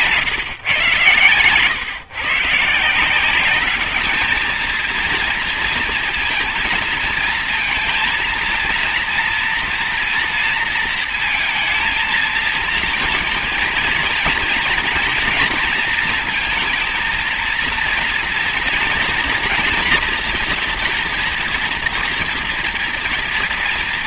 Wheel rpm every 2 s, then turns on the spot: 120, 170, 230, 230, 230, 230, 230, 230, 230, 230, 240, 230.
none